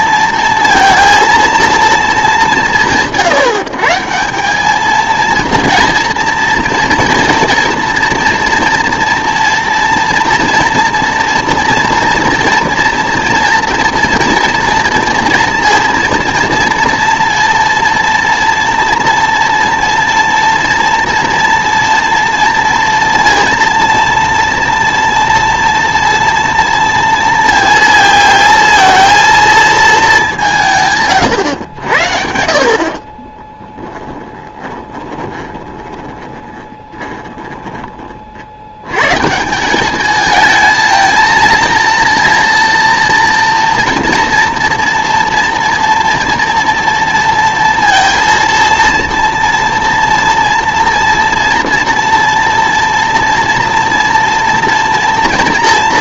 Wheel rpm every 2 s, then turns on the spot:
230, 180, 210, 230, 230, 240, 230, 230, 230, 230, 230, 230, 230, 230, 230, 150, 50, 20, 20, 90, 220, 230, 230, 230, 230, 230, 230, 230.
34-38